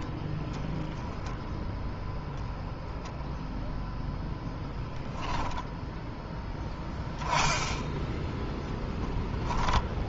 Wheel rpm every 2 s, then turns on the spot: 10, 10, 0, 0, 0.
none